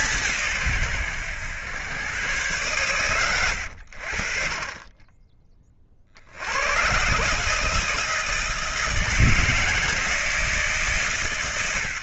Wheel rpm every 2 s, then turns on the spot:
120, 120, 30, 110, 160, 150.
none